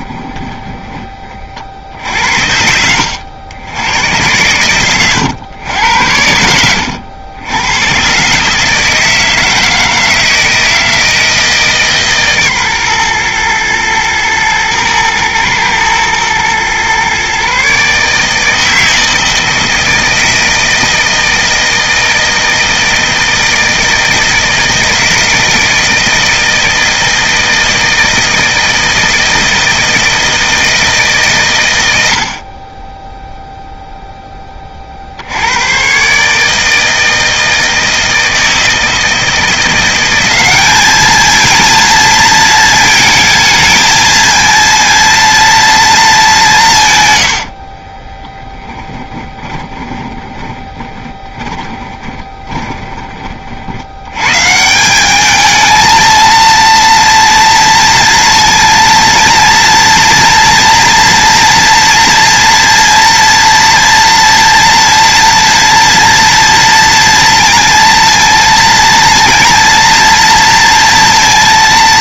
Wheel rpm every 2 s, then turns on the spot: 10, 70, 110, 90, 160, 160, 130, 110, 130, 160, 160, 160, 160, 160, 160, 150, 10, 40, 160, 160, 210, 220, 230, 130, 20, 20, 20, 180, 230, 230, 230, 230, 230, 230, 230, 230.
32-34 48-52